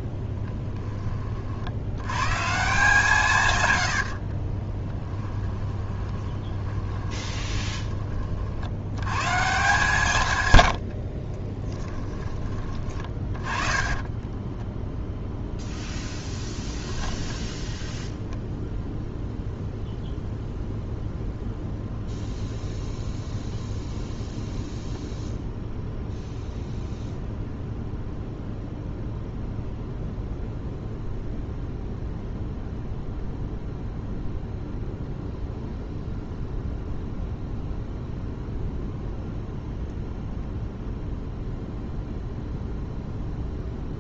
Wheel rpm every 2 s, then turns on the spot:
10, 160, 20, 20, 80, 80, 30, 10, 10, 0, 0, 0, 0, 0, 0, 0, 0, 0, 0, 0, 0, 0.
4-8 10-12 14-16